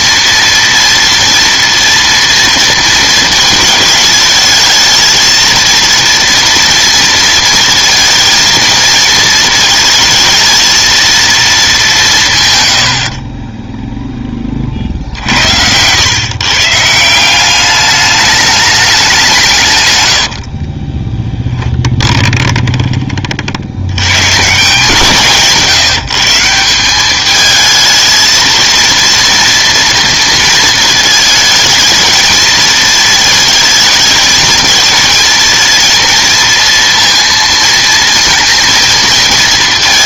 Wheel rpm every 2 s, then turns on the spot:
230, 230, 220, 230, 220, 220, 120, 40, 150, 210, 40, 20, 160, 180, 230, 220, 220, 220, 230, 230.
20-24